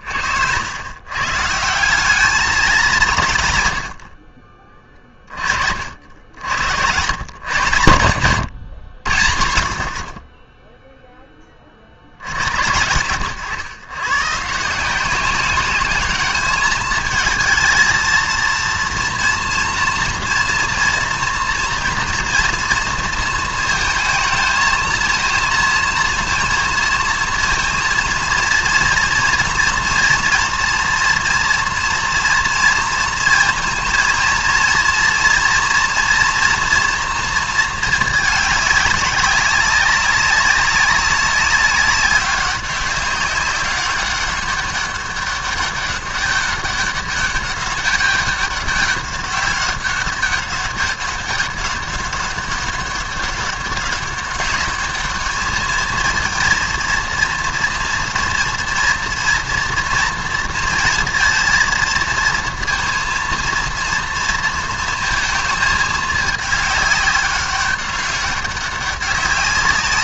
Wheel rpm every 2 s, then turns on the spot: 90, 200, 30, 100, 100, 10, 80, 160, 210, 230, 240, 230, 220, 230, 230, 230, 230, 230, 230, 210, 200, 200, 200, 200, 200, 200, 200, 210, 220, 230, 230, 230, 230, 210, 200.
none